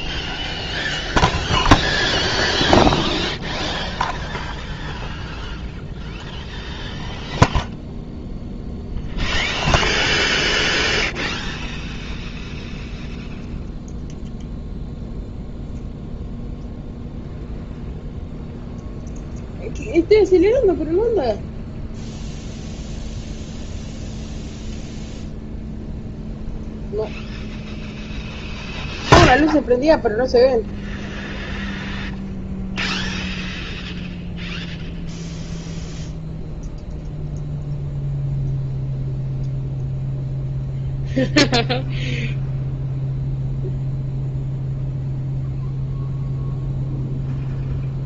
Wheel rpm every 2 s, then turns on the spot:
0, 0, 0, 0, 0, 0, 0, 0, 0, 0, 0, 0, 0, 0, 0, 0, 0, 0, 0, 0, 0, 0, 0, 0.
none